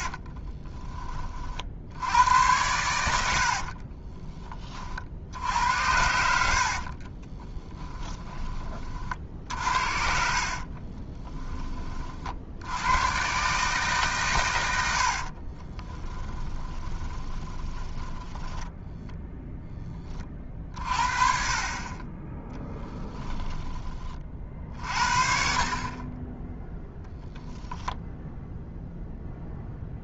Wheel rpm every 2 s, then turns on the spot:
20, 90, 30, 50, 30, 40, 80, 110, 20, 10, 30, 10, 40, 10, 0.
6-8 10-12 16-20 22-24